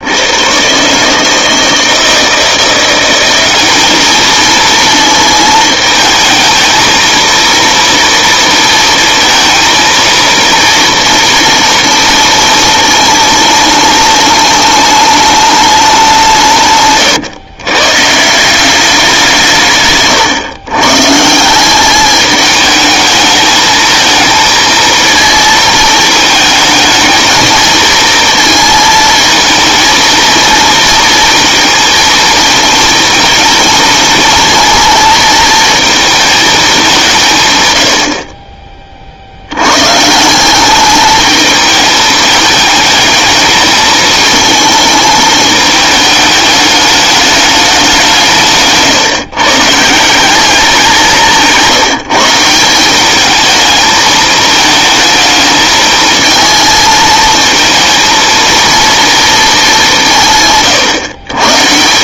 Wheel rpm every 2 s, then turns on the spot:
140, 170, 230, 230, 230, 230, 230, 210, 140, 200, 140, 210, 230, 220, 220, 230, 230, 230, 210, 40, 200, 220, 220, 210, 150, 180, 180, 220, 220, 230, 140.
none